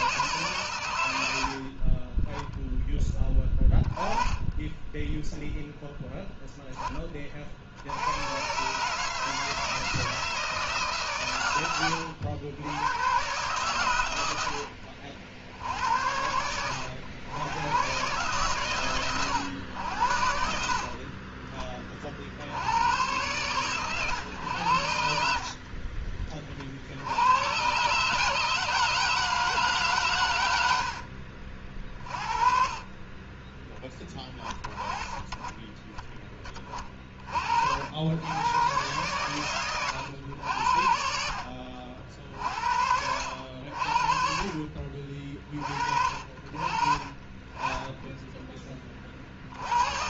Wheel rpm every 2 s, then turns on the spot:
120, 10, 20, 10, 140, 160, 90, 80, 90, 130, 60, 80, 100, 50, 150, 90, 40, 30, 20, 120, 80, 60, 50, 40, 10.
none